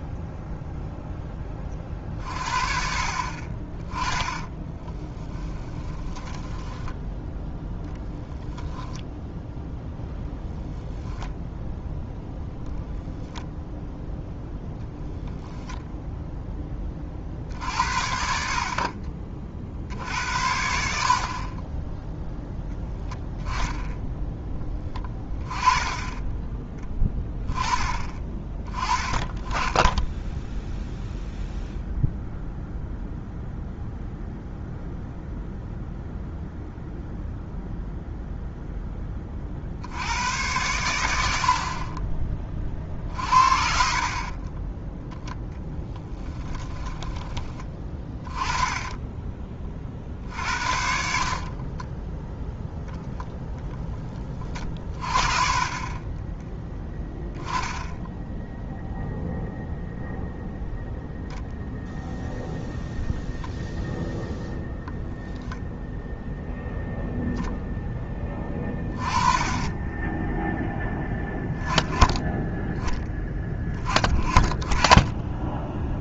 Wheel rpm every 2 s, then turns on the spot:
0, 50, 20, 10, 0, 10, 0, 0, 10, 50, 70, 0, 20, 10, 20, 0, 0, 0, 0, 10, 100, 30, 10, 10, 10, 60, 0, 30, 10, 0, 0, 0, 0, 0, 20, 0, 10, 10.
4-8 44-50